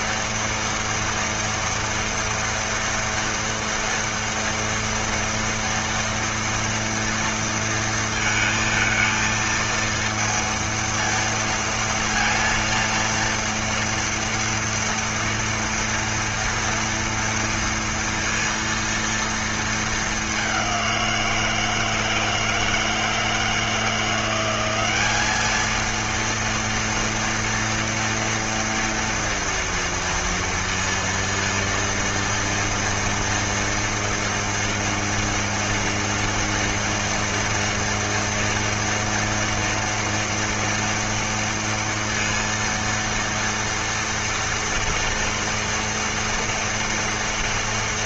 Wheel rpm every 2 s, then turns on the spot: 230, 230, 230, 230, 230, 230, 230, 230, 230, 230, 180, 160, 200, 230, 240, 230, 230, 230, 230, 230, 240, 230, 230, 230.
none